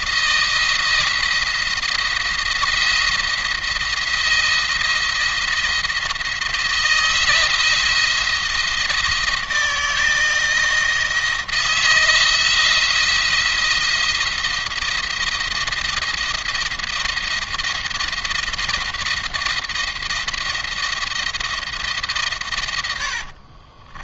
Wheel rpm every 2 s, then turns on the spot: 170, 170, 170, 160, 170, 160, 170, 170, 170, 170, 170, 120.
22-24